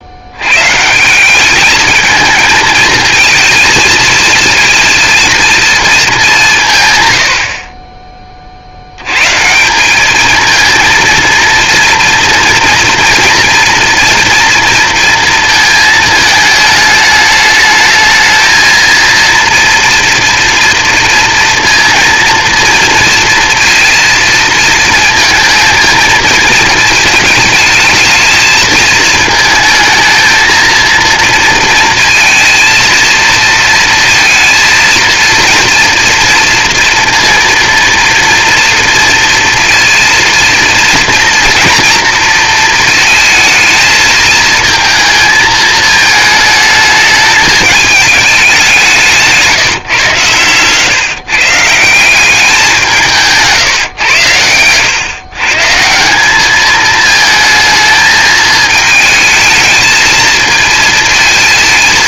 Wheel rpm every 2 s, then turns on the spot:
110, 220, 230, 180, 30, 220, 240, 230, 220, 230, 240, 240, 230, 220, 220, 230, 230, 230, 230, 230, 230, 230, 220, 220, 200, 120, 190, 100, 210, 220, 230.
50-52